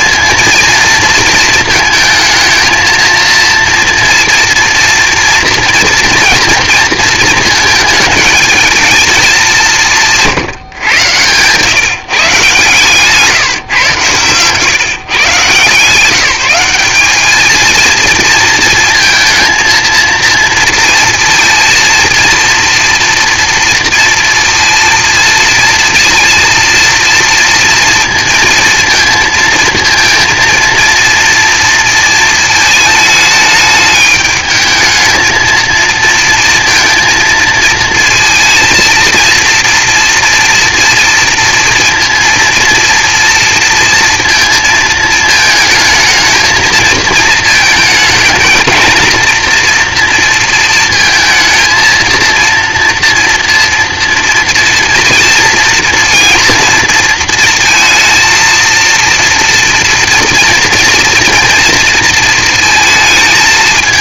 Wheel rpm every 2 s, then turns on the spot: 230, 220, 230, 230, 220, 140, 150, 130, 190, 230, 230, 230, 230, 230, 230, 230, 220, 220, 230, 230, 230, 230, 230, 220, 230, 230, 230, 230, 240, 230, 230, 220.
none